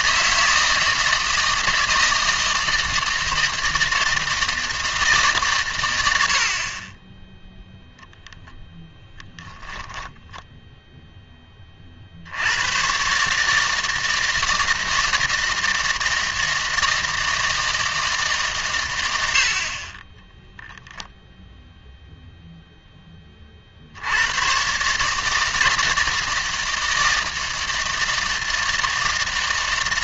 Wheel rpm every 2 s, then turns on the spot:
160, 160, 160, 50, 0, 0, 100, 160, 160, 130, 0, 0, 130, 160, 160.
none